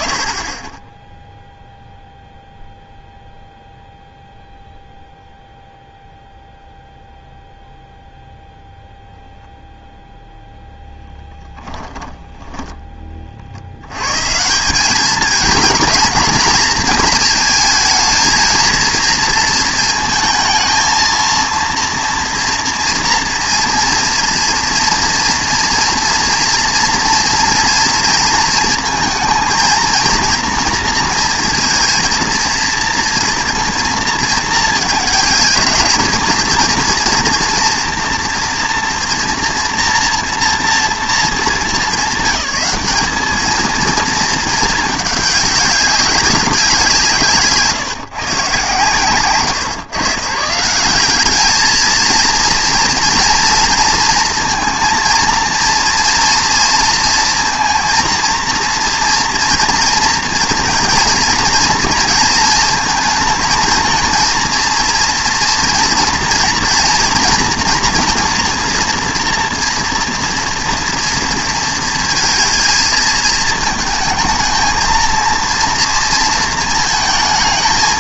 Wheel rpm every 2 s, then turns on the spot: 0, 0, 0, 0, 0, 0, 30, 190, 220, 230, 230, 230, 230, 230, 220, 230, 230, 230, 230, 240, 230, 200, 210, 170, 130, 190, 230, 230, 230, 230, 230, 220, 230, 240, 230, 230, 220, 230, 220.
none